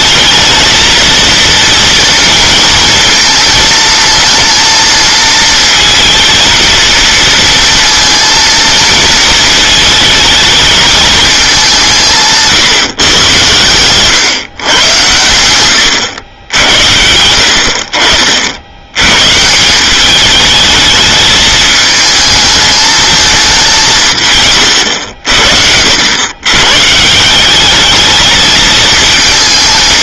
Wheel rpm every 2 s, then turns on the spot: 230, 230, 220, 230, 230, 220, 150, 120, 80, 90, 210, 220, 110, 130, 220.
none